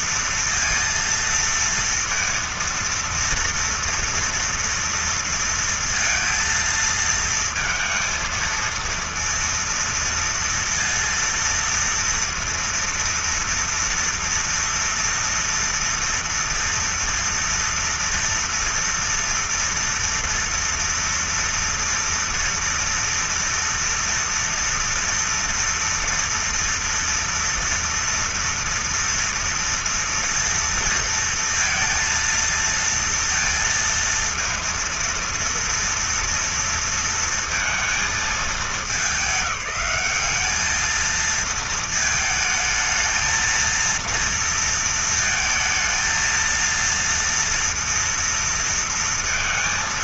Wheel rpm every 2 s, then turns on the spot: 230, 230, 230, 230, 230, 230, 230, 240, 230, 230, 230, 230, 230, 240, 230, 230, 230, 230, 230, 210, 220, 220, 230, 230, 230.
none